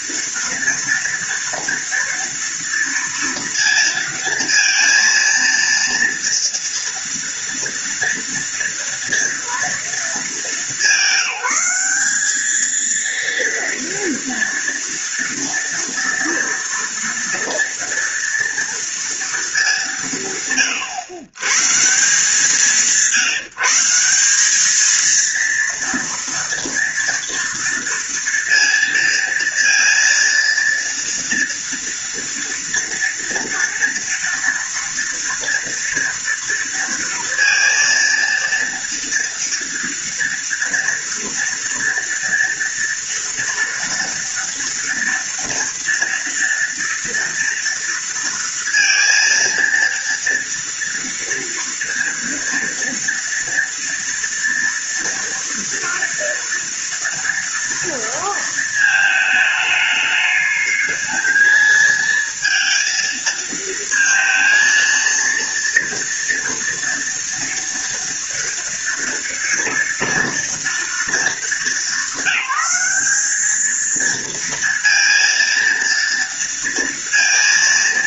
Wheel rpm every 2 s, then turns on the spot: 230, 230, 230, 230, 230, 200, 220, 230, 230, 230, 130, 170, 210, 230, 230, 230, 240, 230, 230, 230, 230, 230, 230, 230, 230, 230, 230, 230, 230, 220, 220, 220, 230, 230, 230, 220, 200, 230, 230.
none